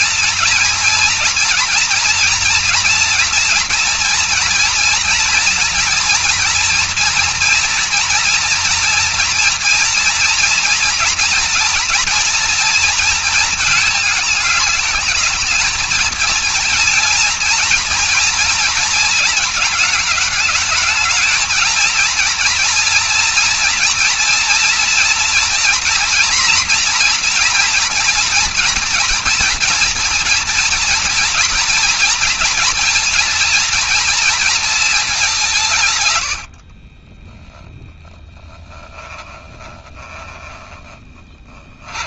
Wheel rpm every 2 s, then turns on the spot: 230, 240, 230, 230, 230, 230, 220, 220, 230, 230, 220, 240, 230, 240, 240, 240, 230, 210, 30, 10, 20.
36-42